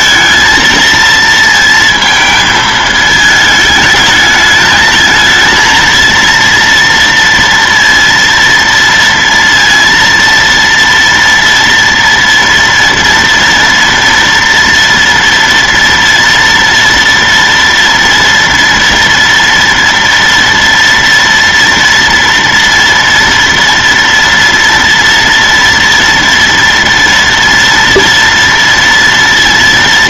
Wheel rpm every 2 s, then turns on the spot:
230, 220, 220, 230, 230, 230, 230, 230, 230, 230, 230, 230, 230, 230, 230.
none